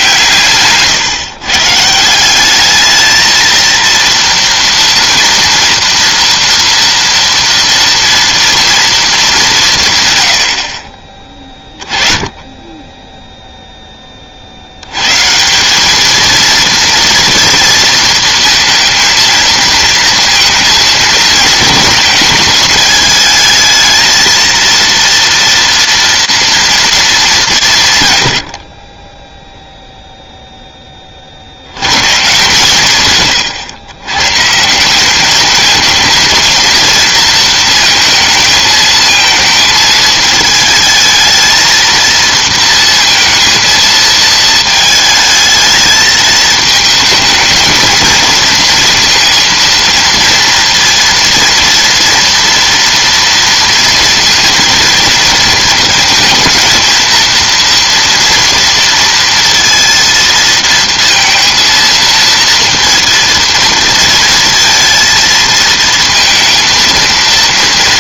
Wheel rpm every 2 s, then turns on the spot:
140, 210, 230, 230, 230, 50, 10, 80, 230, 230, 220, 220, 230, 230, 50, 10, 120, 190, 230, 220, 220, 230, 220, 220, 230, 230, 230, 230, 220, 230, 230, 230, 220, 230.
0-2